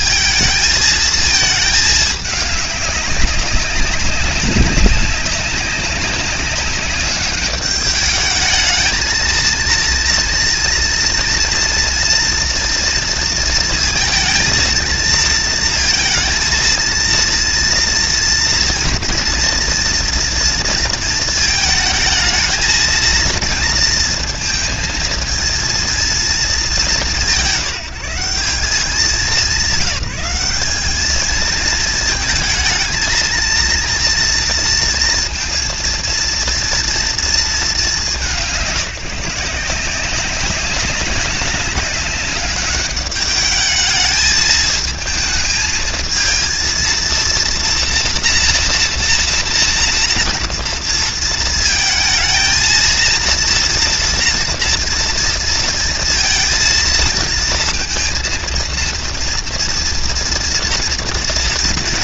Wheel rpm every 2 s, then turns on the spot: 220, 200, 190, 200, 220, 230, 230, 230, 230, 230, 230, 220, 230, 200, 190, 210, 220, 230, 230, 170, 200, 200, 220, 230, 230, 230, 230, 230, 230, 230, 230.
none